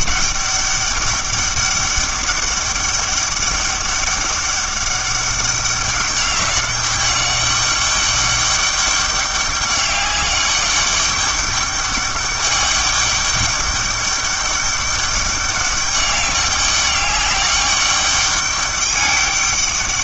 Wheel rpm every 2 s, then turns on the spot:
200, 200, 200, 200, 200, 200, 200, 200, 200, 200.
none